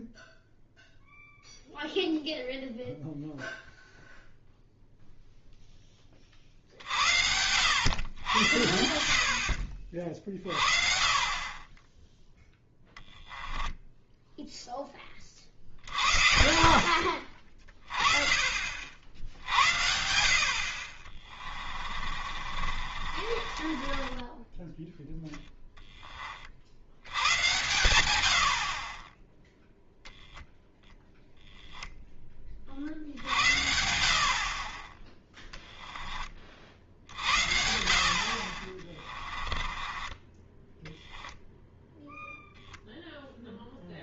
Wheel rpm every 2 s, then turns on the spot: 0, 0, 0, 60, 70, 40, 10, 10, 60, 50, 50, 50, 10, 80, 30, 0, 50, 20, 60, 30, 10, 0.
22-24 38-40